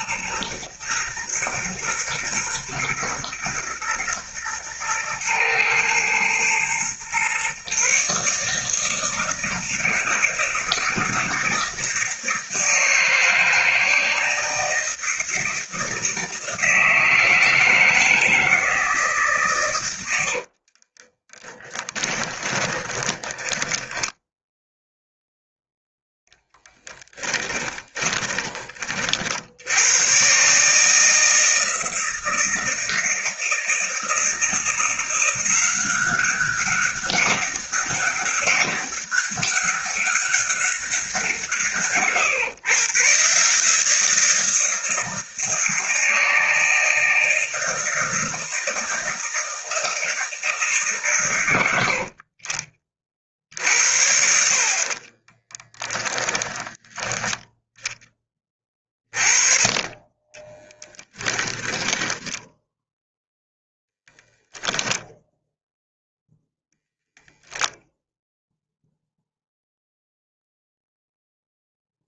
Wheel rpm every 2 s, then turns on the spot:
110, 110, 110, 120, 160, 160, 160, 160, 160, 160, 30, 10, 0, 10, 40, 160, 160, 170, 200, 200, 190, 140, 160, 160, 160, 150, 40, 50, 10, 30, 10, 0, 0, 0, 0, 0.
20-24 26-28 54-56 60-62